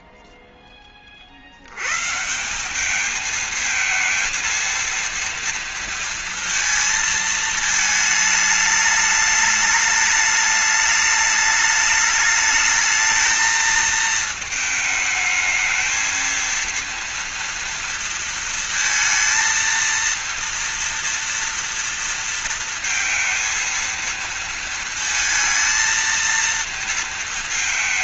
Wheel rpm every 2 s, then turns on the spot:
20, 210, 230, 230, 210, 210, 220, 220, 230, 230, 230, 230, 230, 230.
none